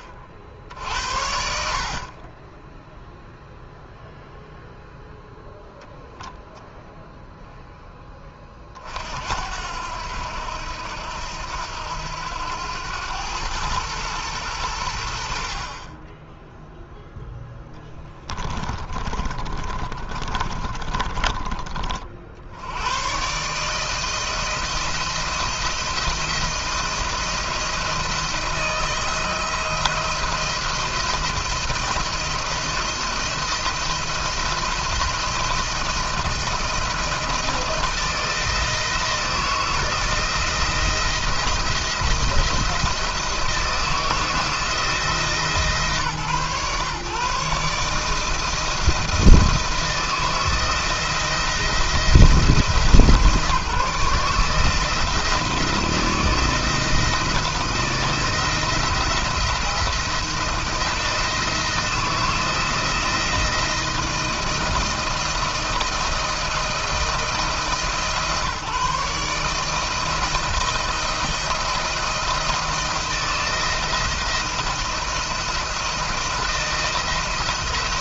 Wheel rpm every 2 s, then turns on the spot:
50, 30, 0, 10, 30, 80, 90, 100, 10, 20, 40, 80, 160, 160, 160, 170, 170, 170, 170, 160, 170, 170, 160, 130, 160, 170, 160, 160, 160, 170, 170, 170, 170, 160, 150, 160, 170, 170, 170.
18-22